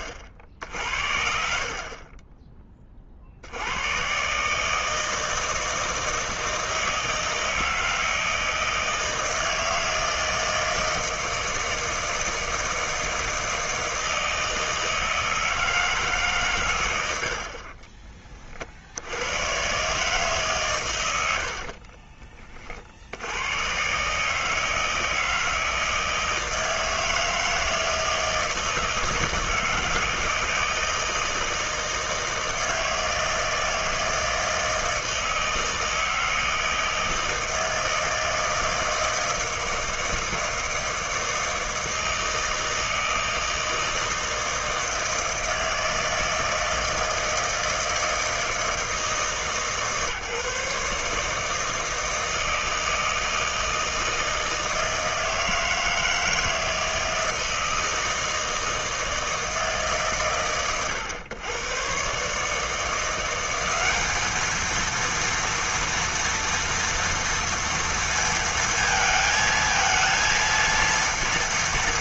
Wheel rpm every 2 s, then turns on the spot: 70, 20, 140, 160, 160, 160, 160, 160, 120, 50, 130, 30, 160, 160, 160, 160, 160, 160, 160, 160, 160, 160, 160, 160, 160, 150, 160, 160, 160, 160, 100, 150, 220, 230, 230, 230.
none